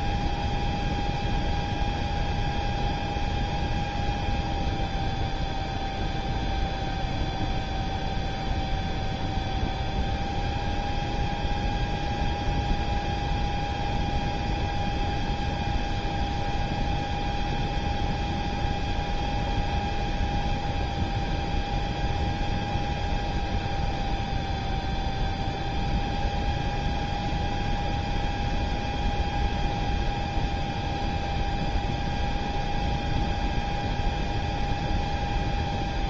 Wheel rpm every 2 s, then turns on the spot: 0, 0, 0, 0, 0, 0, 0, 0, 0, 0, 0, 0, 0, 0, 0, 0, 0, 0.
none